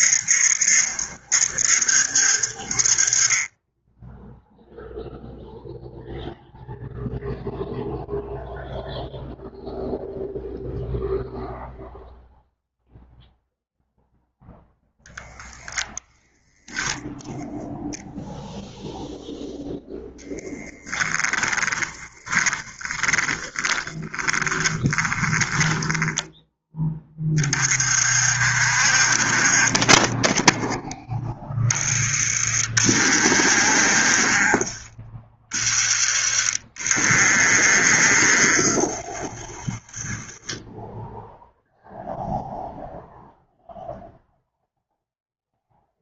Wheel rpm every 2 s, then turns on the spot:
70, 40, 0, 0, 0, 0, 0, 10, 0, 0, 10, 20, 10, 20, 40, 10, 50, 30, 50, 50, 10, 0, 0.
20-26